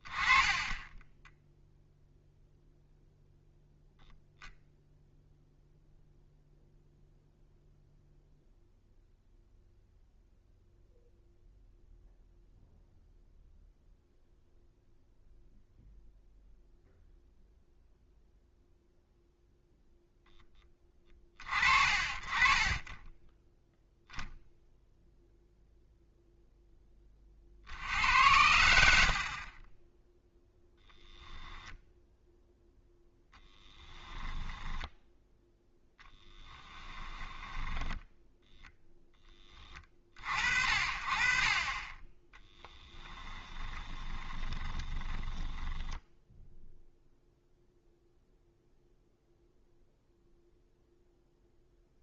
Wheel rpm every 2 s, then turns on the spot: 10, 0, 0, 0, 0, 0, 0, 0, 0, 0, 20, 20, 0, 0, 80, 0, 0, 10, 10, 0, 50, 10, 20, 0, 0, 0.
22-24 34-38 42-46